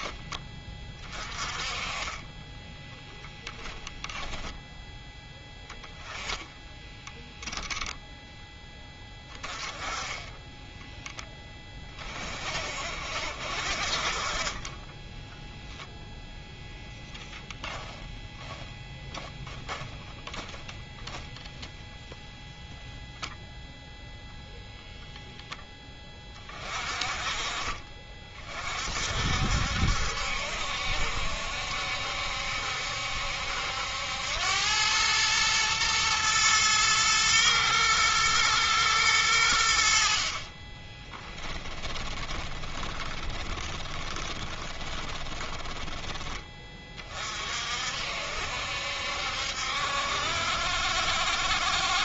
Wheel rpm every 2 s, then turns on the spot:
30, 10, 10, 0, 10, 10, 60, 20, 0, 10, 10, 0, 0, 40, 50, 70, 70, 100, 110, 110, 20, 20, 20, 30, 70, 60.
2-4 14-16 18-20 40-46